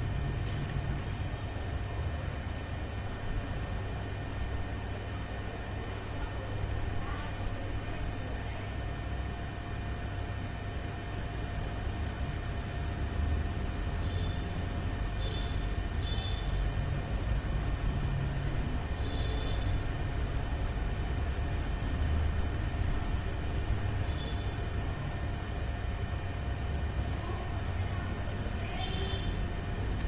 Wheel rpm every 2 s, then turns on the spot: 0, 0, 0, 0, 0, 0, 0, 0, 0, 0, 0, 0, 0, 0, 0.
none